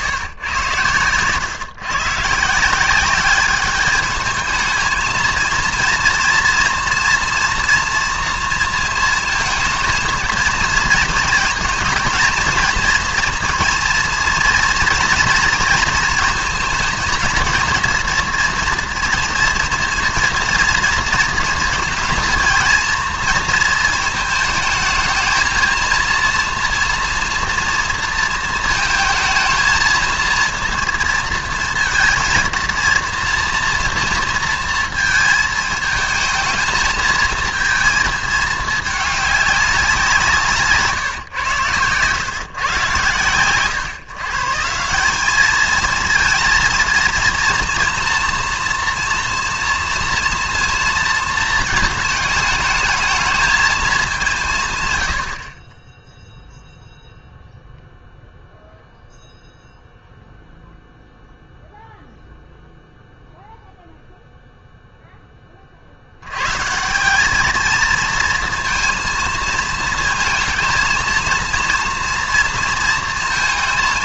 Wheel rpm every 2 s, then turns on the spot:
120, 160, 220, 230, 230, 230, 230, 240, 220, 230, 230, 230, 220, 230, 220, 230, 230, 230, 220, 210, 150, 130, 160, 230, 240, 230, 210, 140, 0, 0, 0, 0, 0, 130, 230, 230, 230.
none